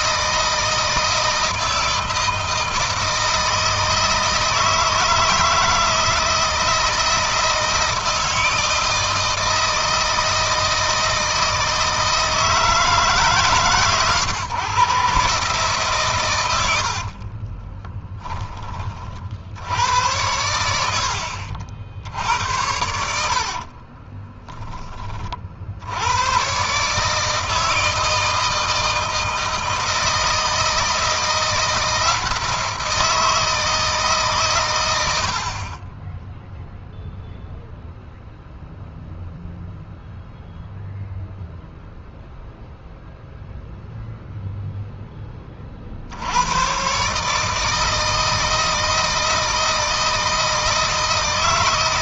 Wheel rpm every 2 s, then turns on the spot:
160, 160, 160, 160, 160, 160, 160, 130, 80, 30, 70, 90, 20, 140, 160, 160, 170, 100, 0, 0, 0, 0, 10, 130, 160, 160.
16-18 22-24